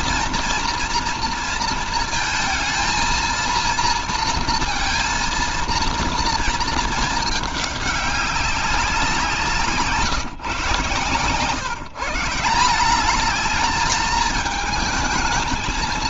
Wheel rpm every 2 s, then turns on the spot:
230, 220, 230, 220, 190, 140, 180, 220.
none